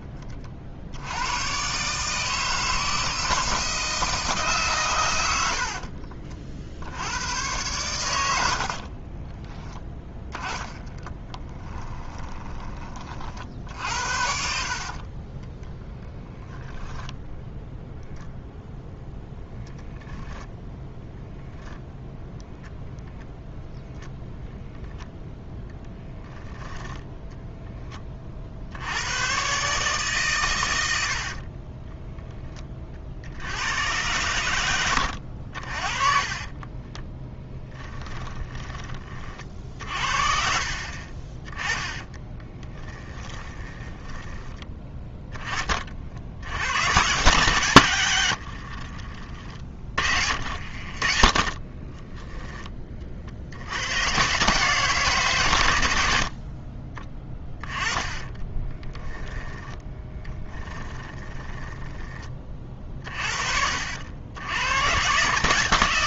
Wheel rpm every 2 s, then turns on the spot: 50, 160, 140, 50, 70, 10, 20, 50, 10, 0, 10, 0, 0, 10, 50, 110, 20, 110, 20, 10, 40, 10, 10, 80, 70, 50, 10, 140, 40, 20, 20, 30, 90.
8-12 16-18 26-28 36-38 42-44 48-52 58-62